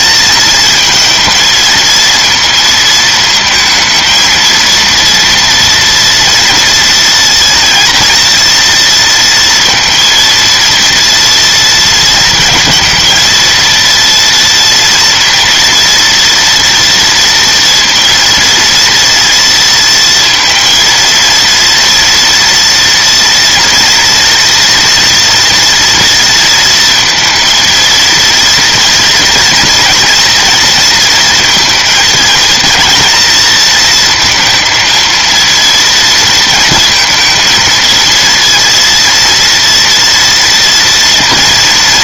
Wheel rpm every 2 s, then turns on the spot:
230, 230, 230, 230, 230, 230, 220, 230, 230, 230, 230, 240, 230, 230, 240, 230, 230, 230, 230, 230, 230.
none